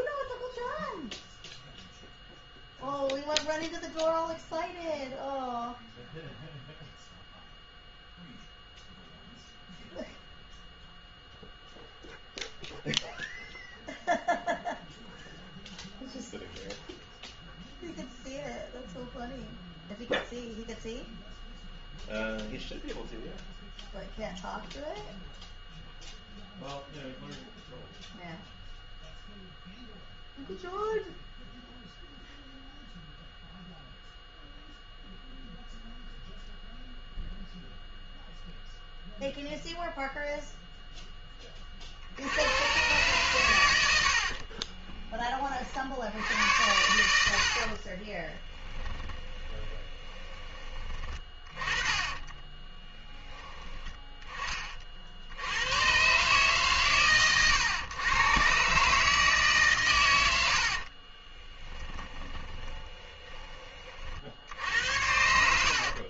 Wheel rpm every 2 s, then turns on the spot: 0, 0, 0, 0, 0, 0, 0, 0, 0, 0, 0, 0, 0, 0, 0, 0, 0, 0, 0, 0, 0, 110, 30, 90, 10, 20, 10, 40, 130, 140, 60, 20, 80.
44-46 48-50 60-64